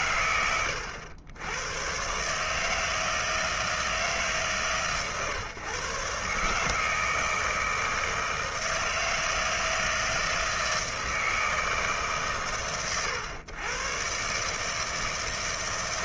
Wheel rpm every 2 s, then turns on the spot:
100, 160, 120, 160, 160, 160, 110, 160.
none